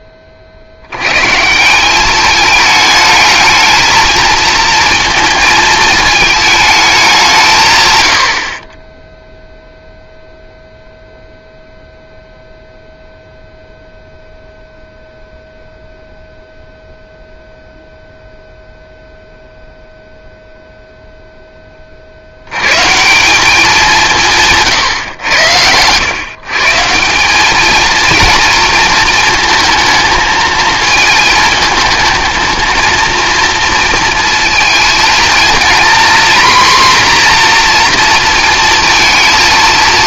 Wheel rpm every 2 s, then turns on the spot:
60, 210, 230, 220, 40, 0, 0, 0, 0, 0, 0, 110, 150, 150, 230, 220, 220, 230, 250, 230.
none